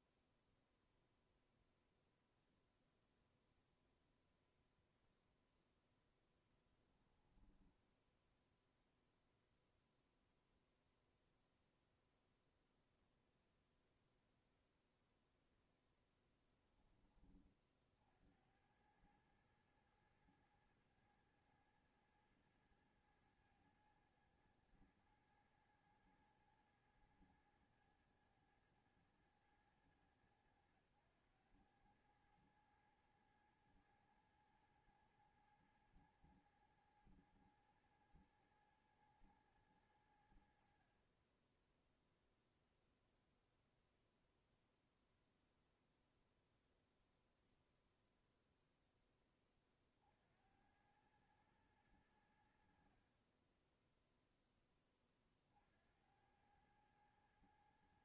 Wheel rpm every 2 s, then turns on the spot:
0, 0, 0, 0, 0, 0, 0, 0, 10, 70, 110, 110, 110, 110, 110, 100, 100, 110, 110, 110, 80, 0, 0, 0, 0, 60, 80, 10, 80.
none